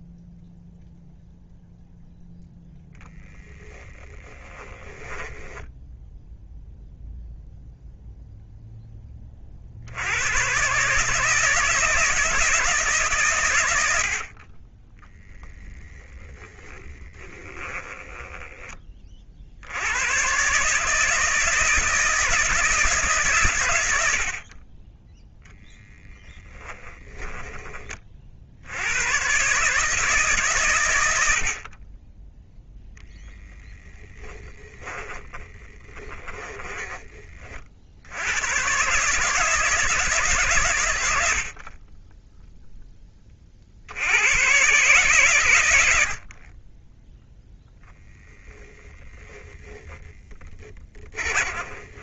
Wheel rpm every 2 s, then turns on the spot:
0, 0, 20, 10, 0, 110, 170, 60, 10, 20, 140, 160, 20, 10, 100, 110, 10, 20, 20, 130, 100, 10, 130, 10, 10, 30.
4-6 16-18 26-28 34-38 48-52